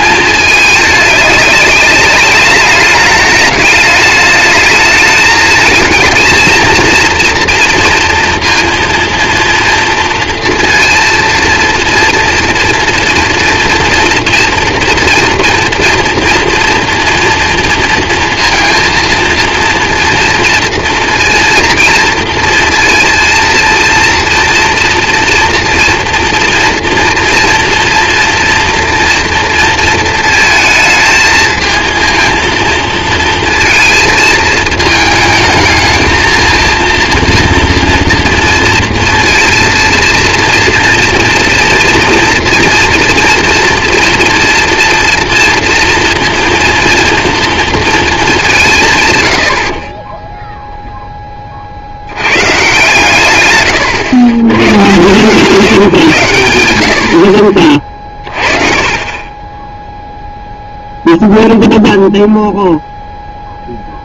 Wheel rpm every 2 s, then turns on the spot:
220, 210, 210, 230, 230, 230, 230, 230, 230, 230, 230, 230, 240, 240, 230, 220, 230, 220, 220, 230, 230, 230, 230, 230, 200, 10, 120, 110, 100, 30, 0, 0.
58-60